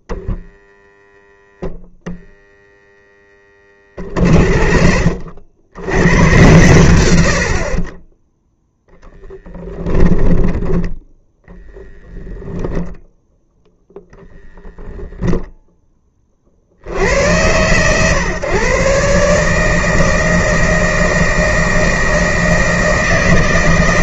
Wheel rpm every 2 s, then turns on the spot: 0, 0, 50, 120, 0, 10, 0, 0, 50, 130, 160, 160.
none